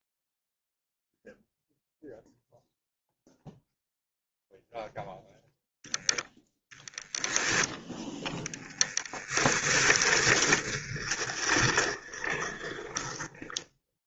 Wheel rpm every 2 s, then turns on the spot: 0, 0, 0, 0, 10, 20, 20.
8-14